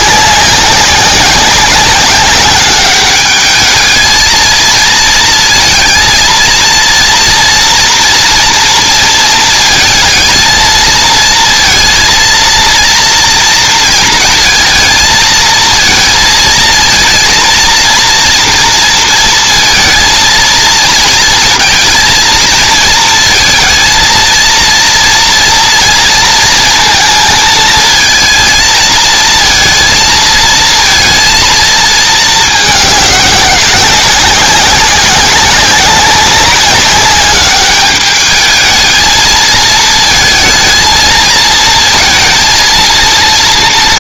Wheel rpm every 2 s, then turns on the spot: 190, 200, 220, 230, 230, 230, 230, 230, 220, 240, 230, 220, 230, 230, 220, 230, 210, 190, 200, 220, 220, 220.
none